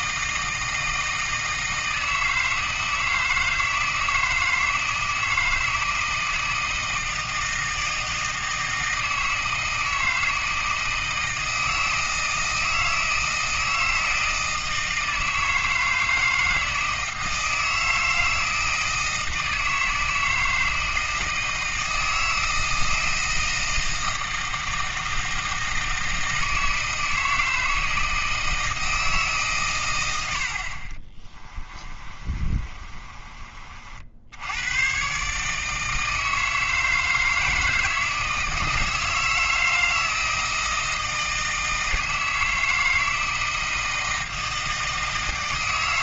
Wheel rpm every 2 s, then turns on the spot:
160, 160, 160, 160, 160, 160, 160, 160, 160, 160, 160, 160, 160, 160, 160, 50, 30, 110, 160, 160, 160, 160, 160.
32-34